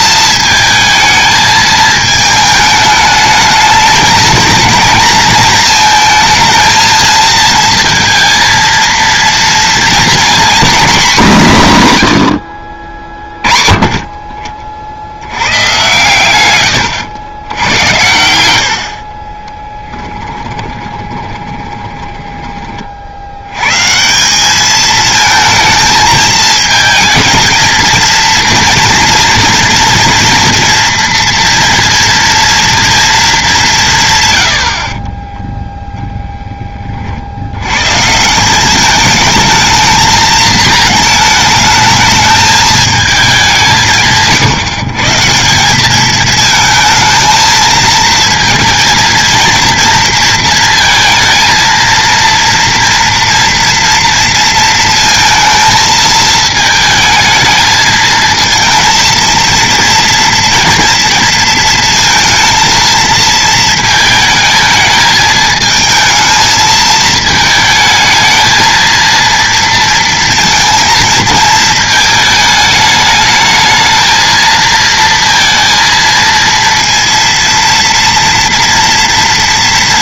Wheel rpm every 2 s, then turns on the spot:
220, 220, 220, 230, 230, 250, 60, 40, 130, 80, 20, 30, 210, 220, 240, 230, 230, 40, 20, 200, 220, 220, 160, 220, 230, 230, 230, 230, 220, 230, 230, 230, 220, 220, 230, 230, 220, 220, 230, 230.
16-18 20-22